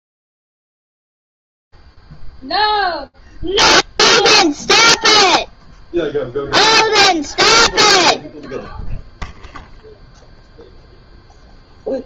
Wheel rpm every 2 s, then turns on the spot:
30, 0, 0, 0, 0, 0.
none